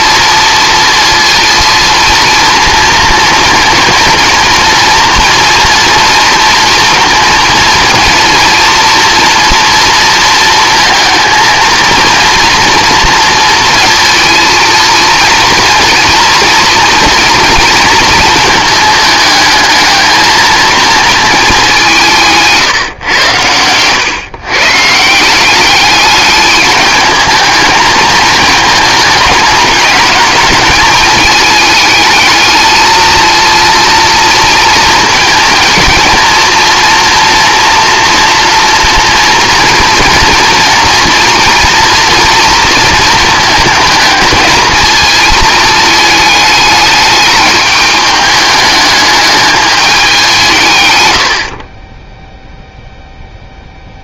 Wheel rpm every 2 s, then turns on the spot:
230, 230, 240, 230, 230, 230, 230, 230, 230, 220, 230, 140, 150, 210, 220, 210, 220, 230, 230, 230, 240, 230, 230, 210, 210, 130, 0.
none